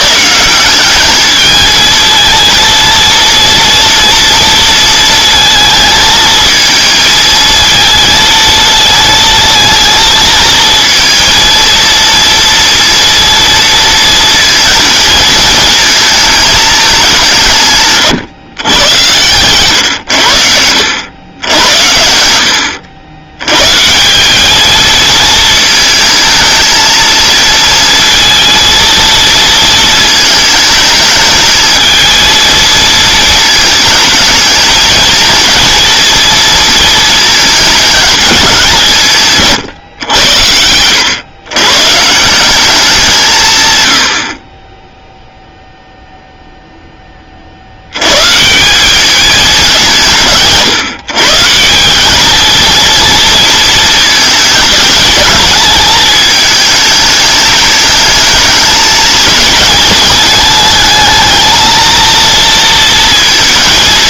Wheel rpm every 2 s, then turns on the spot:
170, 230, 230, 220, 230, 230, 230, 230, 220, 130, 90, 80, 200, 220, 230, 220, 220, 210, 230, 200, 90, 190, 30, 0, 150, 160, 220, 220, 210, 220, 220, 230.
none